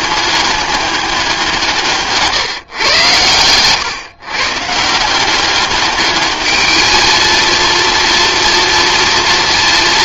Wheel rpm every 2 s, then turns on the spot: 200, 120, 160, 220, 230.
none